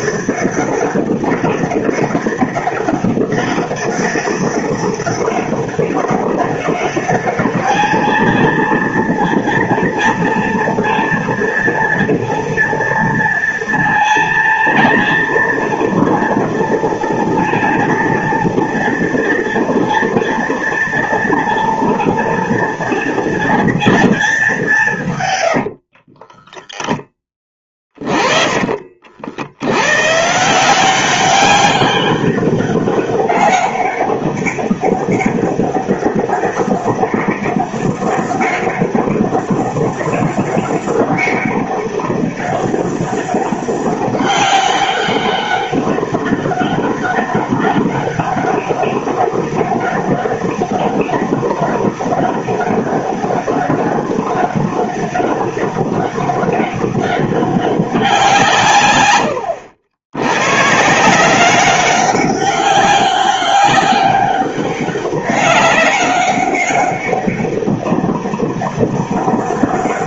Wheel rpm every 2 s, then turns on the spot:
200, 200, 200, 200, 230, 230, 230, 230, 230, 230, 230, 230, 200, 10, 40, 170, 200, 200, 200, 200, 200, 200, 200, 200, 200, 200, 200, 200, 200, 150, 130, 200, 200, 200, 200.
26-28